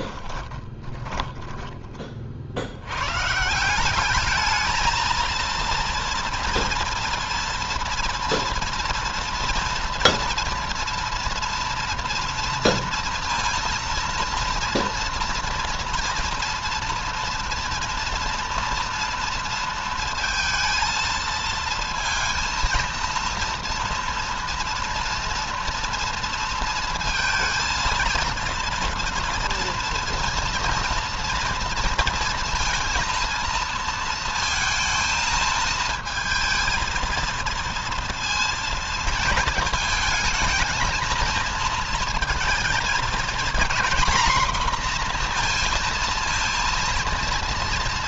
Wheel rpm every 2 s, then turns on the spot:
20, 110, 220, 230, 230, 230, 230, 230, 230, 230, 230, 230, 230, 230, 230, 230, 230, 220, 230, 230, 230, 220, 230, 230.
0-2